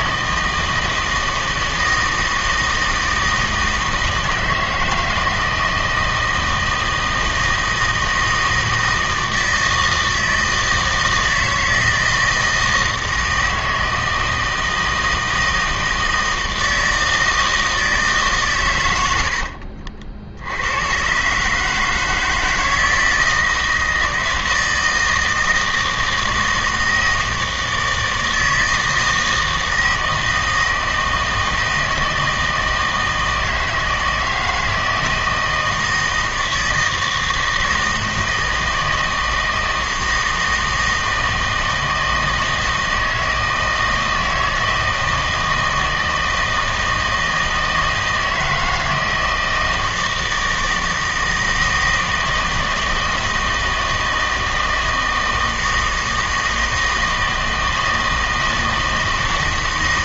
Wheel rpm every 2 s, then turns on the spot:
160, 160, 160, 160, 160, 160, 160, 160, 160, 110, 100, 160, 160, 160, 160, 160, 160, 160, 160, 160, 160, 160, 160, 160, 160, 160, 160, 160, 160, 160.
none